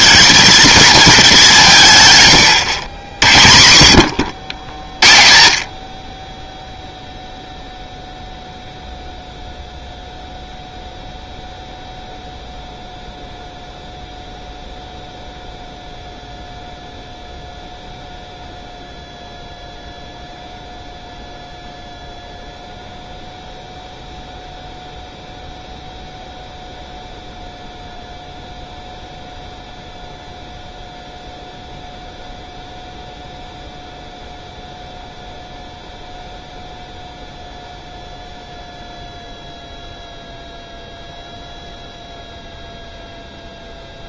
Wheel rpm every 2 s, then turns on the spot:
220, 80, 60, 0, 0, 0, 0, 0, 0, 0, 0, 0, 0, 0, 0, 0, 0, 0, 0, 0, 0, 0.
none